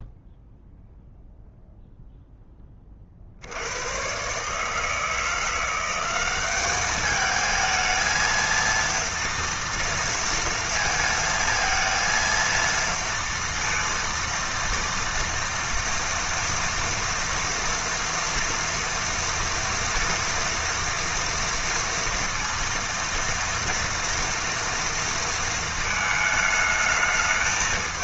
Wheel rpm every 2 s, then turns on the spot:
0, 10, 140, 200, 230, 230, 230, 230, 230, 240, 230, 230, 230, 220.
none